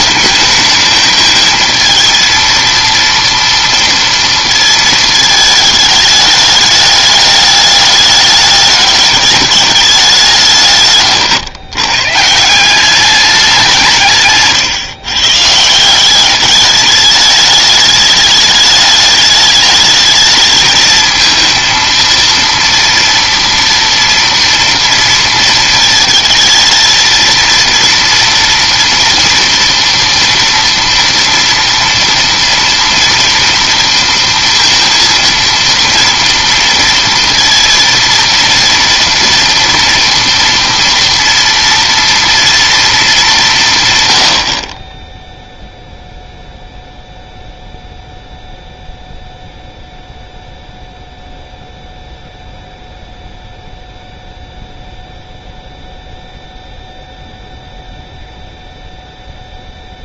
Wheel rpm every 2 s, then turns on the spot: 220, 230, 210, 210, 190, 140, 150, 180, 210, 210, 230, 230, 220, 230, 230, 230, 230, 230, 230, 230, 230, 100, 0, 0, 0, 0, 0, 0, 0, 0.
none